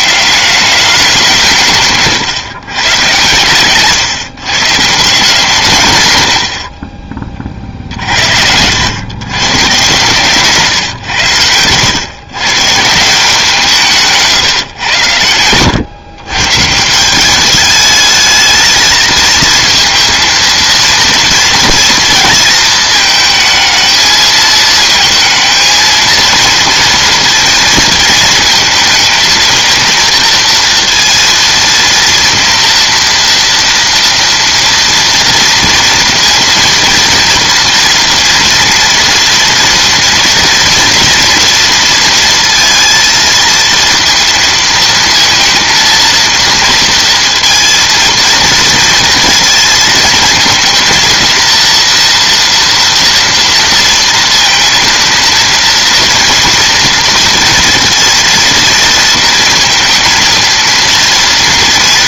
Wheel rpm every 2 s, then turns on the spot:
190, 130, 160, 40, 100, 120, 150, 110, 160, 220, 230, 220, 220, 230, 230, 230, 230, 230, 230, 230, 240, 230, 230, 230, 220, 230, 230, 230, 230, 230, 230.
6-8